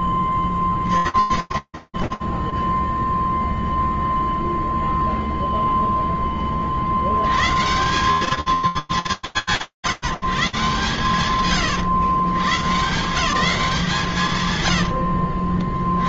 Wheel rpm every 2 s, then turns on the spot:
0, 60, 0, 10, 180, 150, 120, 180.
none